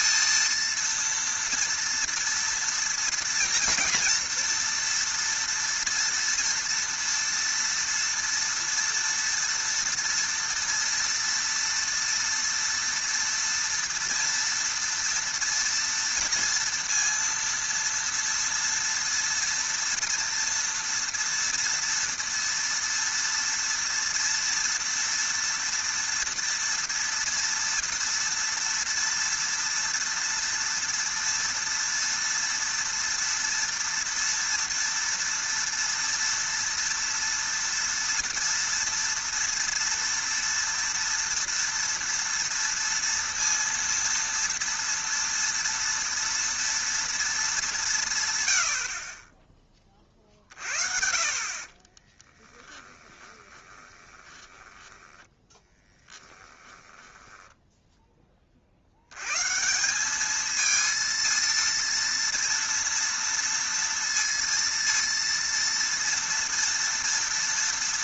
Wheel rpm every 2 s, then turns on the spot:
230, 230, 230, 230, 230, 230, 230, 230, 230, 230, 230, 230, 230, 230, 230, 240, 230, 230, 230, 230, 230, 230, 230, 230, 80, 50, 10, 10, 10, 40, 220, 230, 230, 230.
52-58